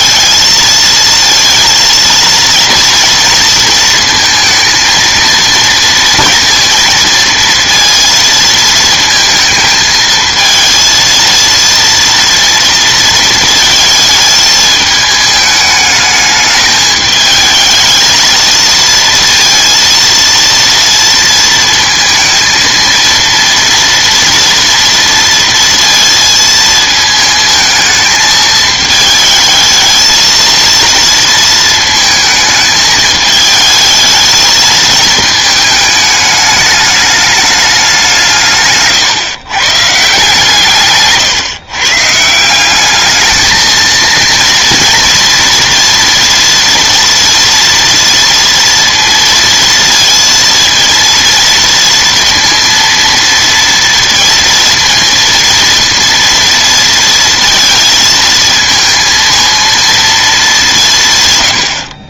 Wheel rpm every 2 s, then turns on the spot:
220, 230, 220, 230, 220, 230, 230, 220, 210, 230, 230, 230, 230, 220, 220, 230, 220, 220, 210, 140, 140, 190, 240, 230, 230, 230, 230, 230, 230, 230, 180.
none